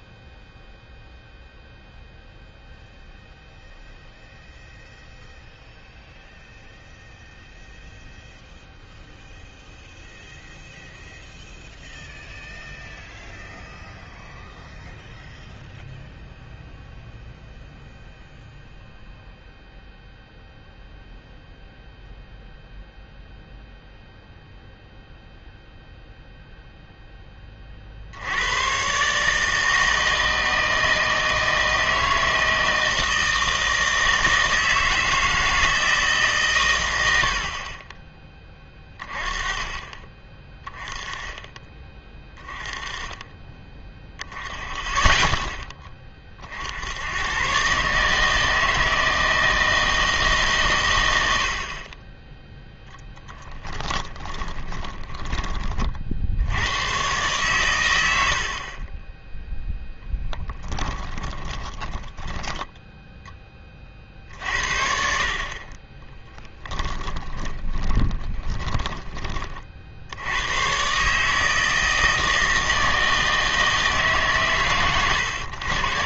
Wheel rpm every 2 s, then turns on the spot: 0, 0, 0, 0, 0, 0, 0, 0, 0, 0, 0, 0, 0, 0, 90, 160, 160, 160, 130, 20, 20, 20, 0, 70, 160, 130, 10, 20, 90, 50, 10, 10, 70, 10, 10, 110, 160, 140.
54-56 60-64 66-70